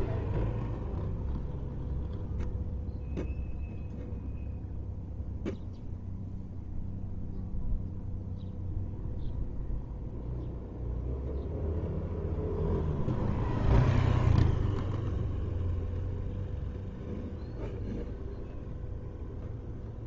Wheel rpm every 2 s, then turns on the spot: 0, 0, 0, 0, 0, 0, 0, 0, 0, 0.
none